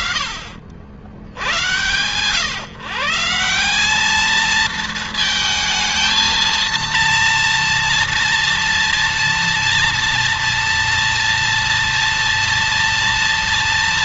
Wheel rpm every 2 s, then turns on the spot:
80, 160, 220, 230, 240, 230, 230.
none